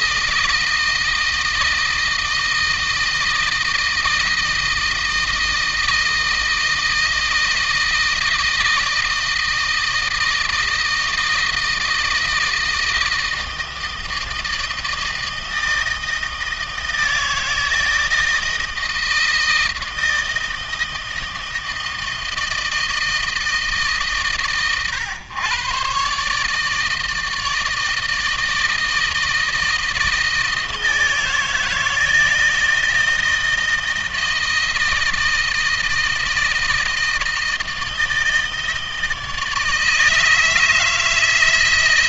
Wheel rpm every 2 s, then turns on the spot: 160, 160, 160, 160, 160, 160, 160, 160, 160, 160, 160, 160, 120, 160, 160, 160, 160, 160, 160, 160, 160.
none